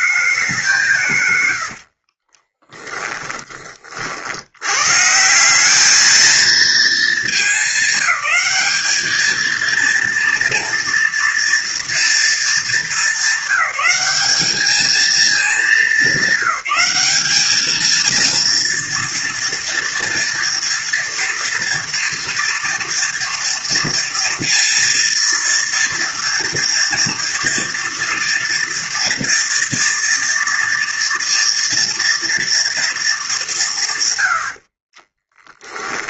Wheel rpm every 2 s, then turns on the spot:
180, 20, 100, 220, 210, 230, 220, 210, 190, 230, 230, 240, 230, 230, 230, 230, 230, 70.
2-4 34-36